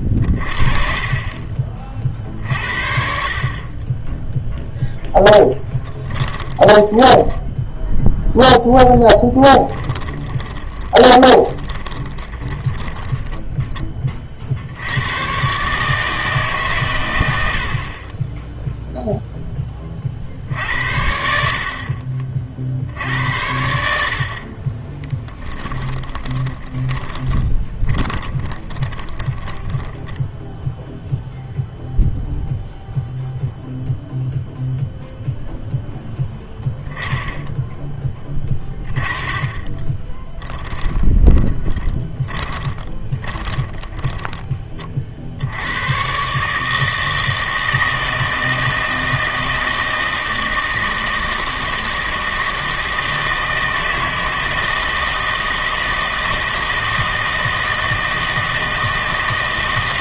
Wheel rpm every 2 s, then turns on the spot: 30, 50, 0, 10, 0, 10, 20, 80, 130, 0, 70, 60, 30, 20, 20, 0, 0, 0, 10, 20, 10, 20, 20, 150, 160, 160, 160, 160, 160, 160.
0-2 6-8 10-14 24-30 40-44